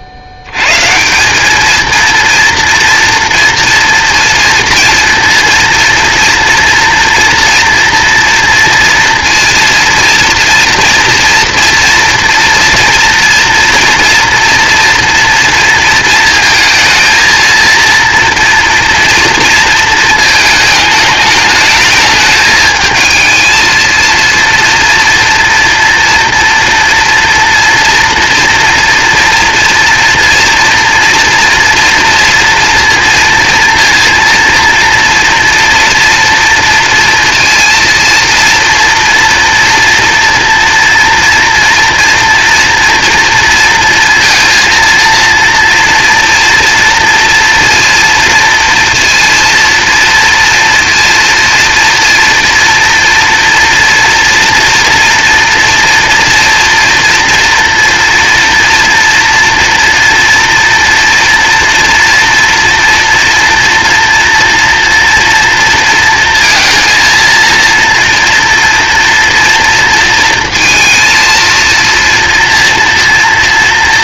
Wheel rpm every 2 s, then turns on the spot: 110, 230, 230, 230, 230, 240, 230, 230, 220, 230, 220, 220, 230, 230, 240, 230, 230, 230, 230, 230, 230, 230, 230, 230, 230, 230, 240, 240, 230, 230, 230, 230, 230, 230, 230, 230, 230.
none